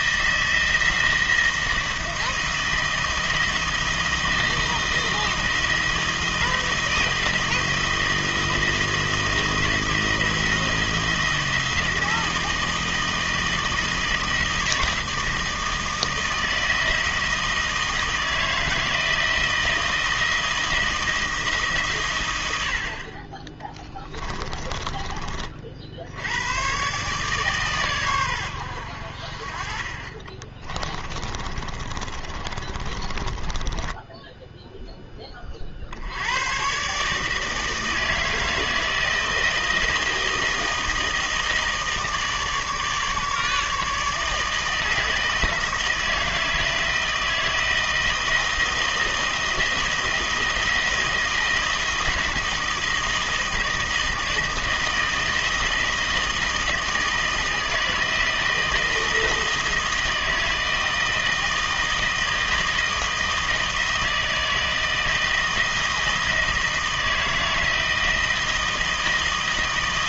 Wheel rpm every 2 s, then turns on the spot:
160, 160, 170, 160, 160, 160, 160, 160, 160, 160, 160, 80, 20, 110, 90, 30, 30, 0, 120, 160, 160, 150, 160, 160, 160, 160, 160, 160, 160, 160, 160, 160, 160, 160, 160.
24-26 30-34